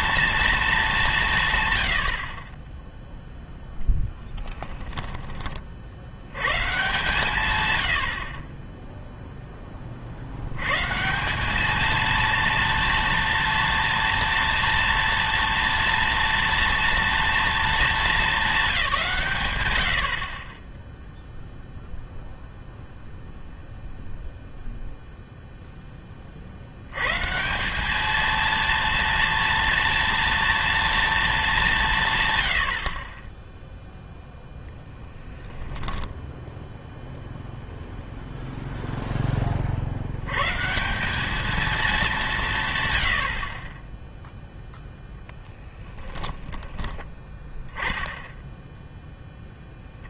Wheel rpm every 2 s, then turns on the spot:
220, 20, 10, 130, 20, 120, 230, 230, 230, 200, 20, 0, 0, 70, 230, 230, 90, 0, 0, 0, 150, 130, 0, 10, 0.
4-6 46-48